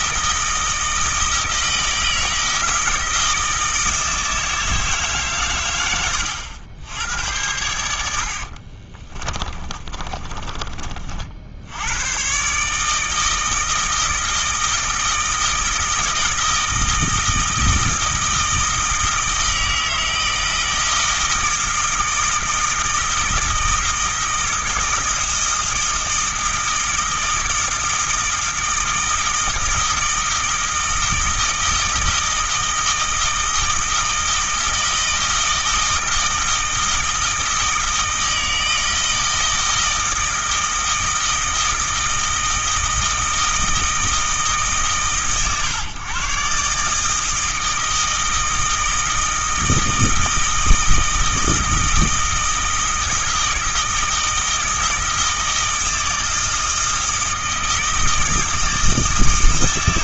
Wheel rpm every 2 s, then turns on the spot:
160, 160, 150, 90, 30, 40, 160, 160, 160, 160, 160, 160, 160, 160, 160, 160, 160, 160, 160, 160, 160, 160, 120, 150, 160, 160, 160, 160, 160, 160.
8-10